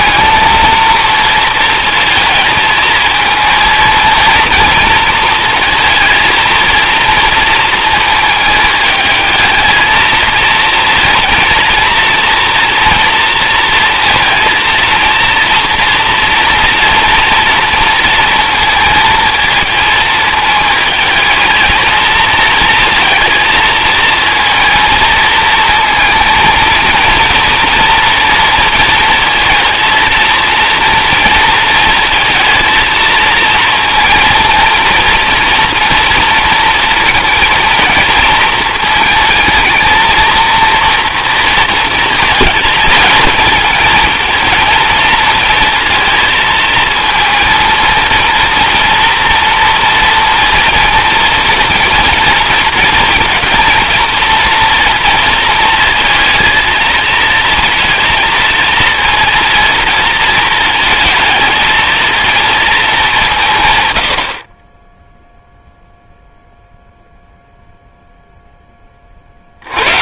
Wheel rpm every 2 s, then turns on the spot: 230, 220, 230, 230, 220, 230, 230, 230, 230, 230, 220, 230, 230, 230, 230, 230, 220, 230, 230, 230, 230, 220, 230, 220, 230, 230, 230, 230, 220, 230, 220, 220, 60, 0, 0.
none